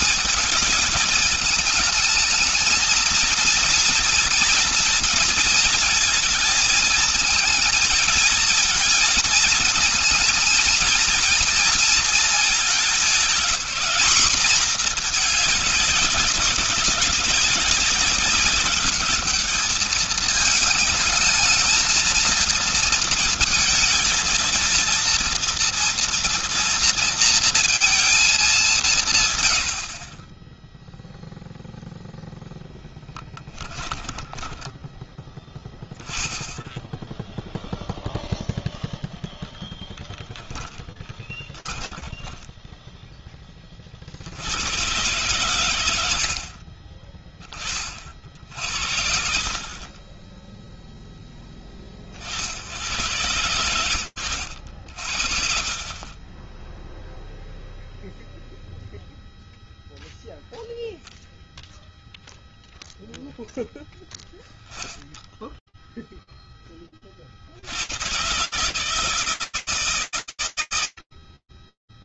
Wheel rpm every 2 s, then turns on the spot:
220, 230, 230, 220, 230, 230, 210, 220, 200, 210, 220, 220, 230, 230, 120, 0, 10, 10, 0, 0, 10, 10, 120, 30, 60, 20, 110, 60, 0, 0, 0, 0, 0, 40, 160, 70.
32-36 40-42 46-48